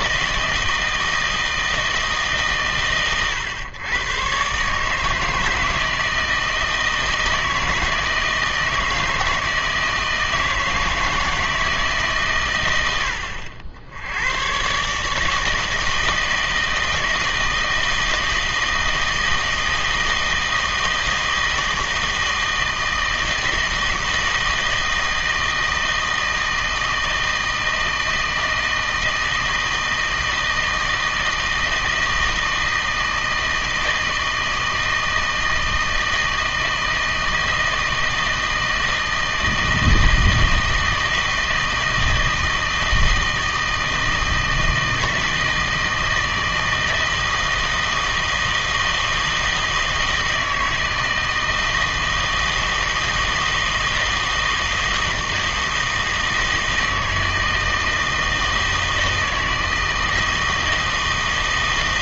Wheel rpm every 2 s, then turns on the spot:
160, 140, 130, 160, 160, 160, 120, 110, 160, 160, 160, 160, 160, 160, 160, 160, 160, 160, 160, 160, 160, 160, 160, 160, 160, 160, 160, 160, 160, 160, 160.
none